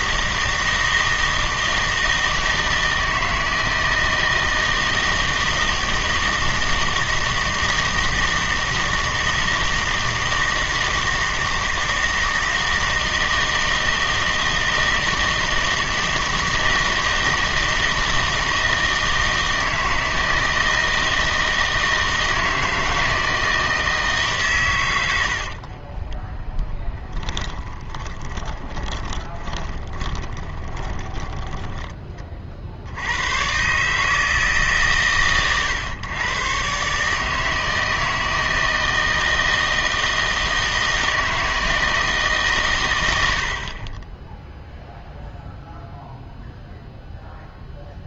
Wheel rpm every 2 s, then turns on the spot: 160, 160, 160, 160, 160, 160, 160, 160, 160, 160, 160, 160, 60, 10, 20, 20, 80, 140, 140, 160, 160, 100, 0, 0.
26-32